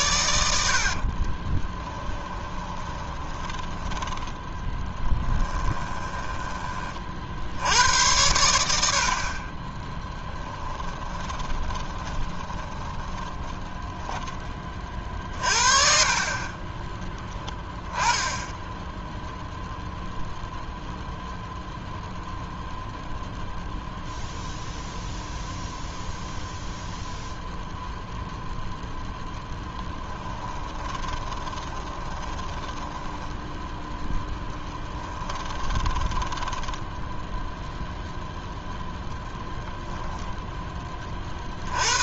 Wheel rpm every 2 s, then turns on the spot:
70, 20, 10, 20, 80, 10, 20, 30, 20, 10, 0, 0, 0, 0, 0, 20, 10, 10, 10, 0, 0.
0-6 10-14 16-20 30-38